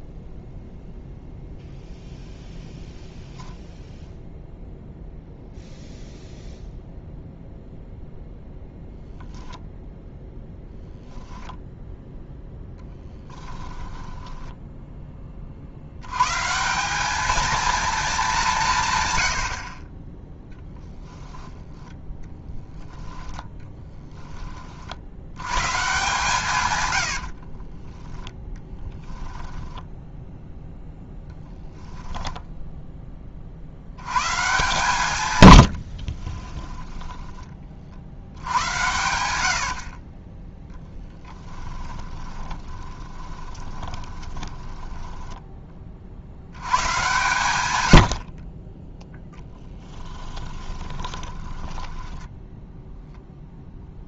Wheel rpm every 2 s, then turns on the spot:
0, 0, 0, 0, 0, 10, 10, 10, 190, 150, 20, 10, 60, 100, 10, 0, 10, 120, 10, 100, 10, 10, 10, 110, 20, 20, 0.
12-14 20-24 26-28 36-38 42-46 50-52